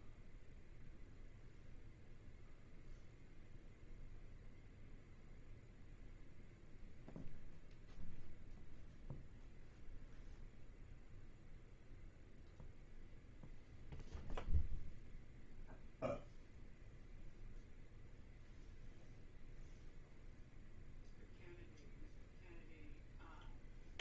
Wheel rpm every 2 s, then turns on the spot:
0, 0, 0, 0, 0, 0, 0, 0, 0, 0, 0, 0.
none